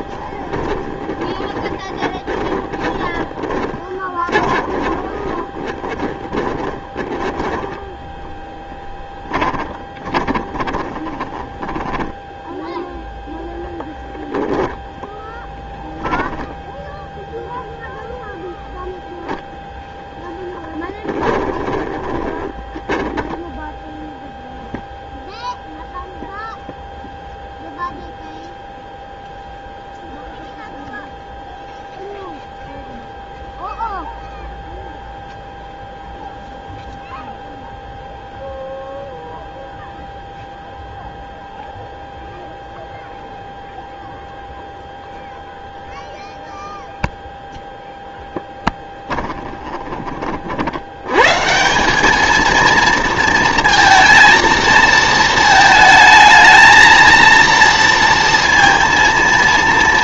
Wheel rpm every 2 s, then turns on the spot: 20, 20, 30, 20, 10, 20, 0, 10, 0, 0, 10, 10, 0, 0, 0, 0, 0, 0, 0, 0, 0, 0, 0, 0, 10, 50, 220, 230, 230, 230.
0-8 10-12 20-22 48-50